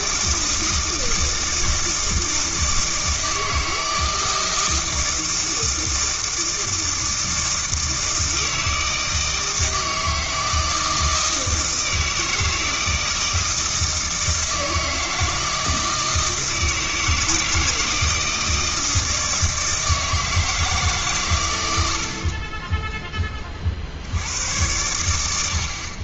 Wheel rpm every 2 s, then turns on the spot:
160, 160, 160, 160, 160, 160, 160, 160, 160, 160, 150, 10, 100.
none